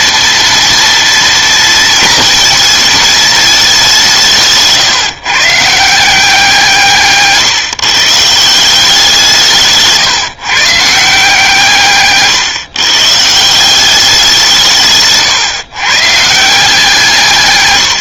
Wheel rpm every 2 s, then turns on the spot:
230, 220, 140, 150, 180, 150, 140, 150, 170.
none